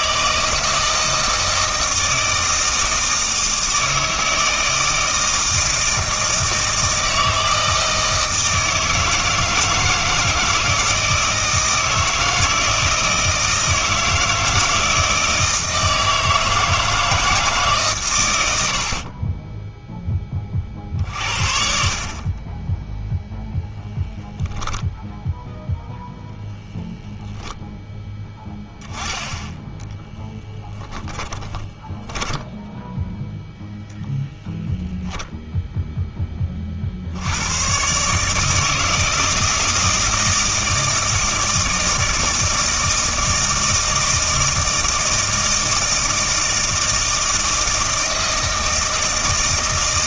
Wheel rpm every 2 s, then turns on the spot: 160, 160, 160, 160, 160, 160, 160, 160, 160, 70, 40, 20, 10, 0, 10, 10, 10, 0, 30, 160, 160, 160, 160, 160, 160.
24-26 30-34